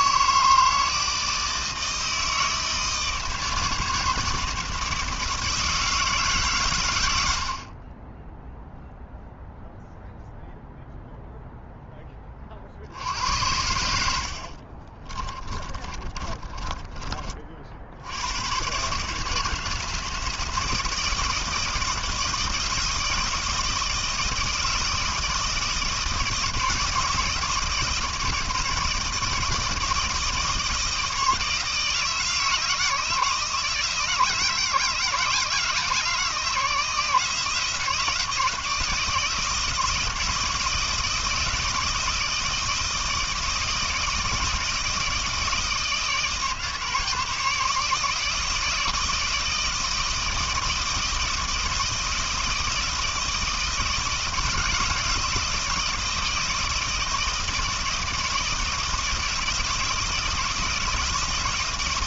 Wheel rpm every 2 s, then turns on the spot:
160, 160, 160, 140, 0, 0, 50, 50, 30, 120, 160, 160, 160, 160, 160, 160, 160, 160, 160, 170, 160, 160, 160, 160, 160, 160, 160, 160, 160, 160, 160.
14-18